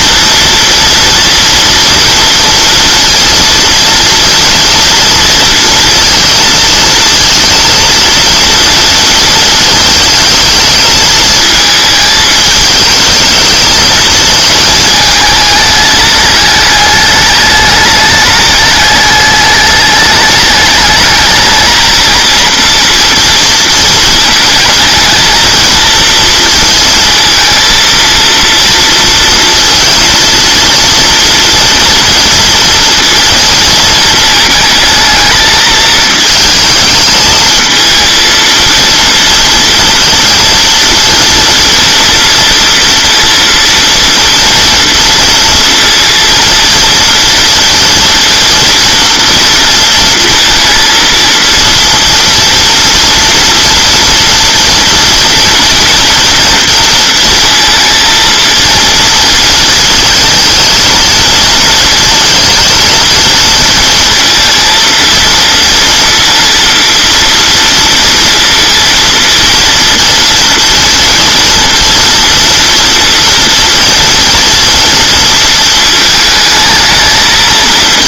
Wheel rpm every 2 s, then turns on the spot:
230, 230, 230, 230, 230, 220, 210, 220, 210, 210, 210, 230, 220, 220, 230, 230, 230, 220, 220, 230, 230, 230, 230, 230, 230, 230, 230, 230, 230, 230, 230, 230, 230, 230, 230, 230, 230, 240, 220.
none